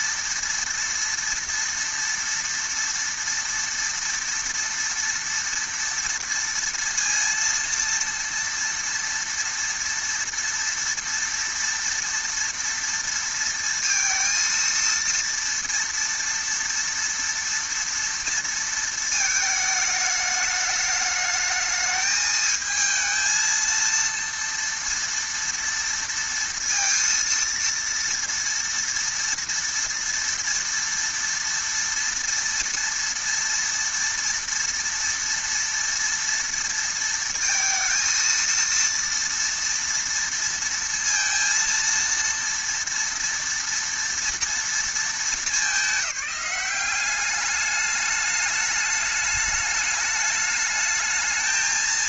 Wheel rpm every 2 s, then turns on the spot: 230, 230, 230, 230, 230, 230, 230, 230, 230, 230, 210, 220, 230, 230, 230, 230, 230, 230, 230, 230, 230, 230, 220, 180, 210, 210.
none